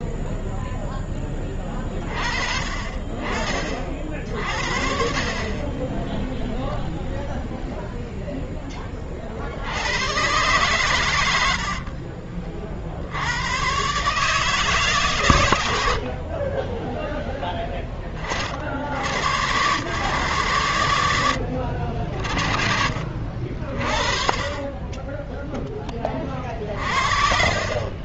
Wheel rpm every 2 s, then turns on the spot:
0, 30, 60, 0, 10, 110, 40, 140, 40, 50, 120, 60, 20, 30.
none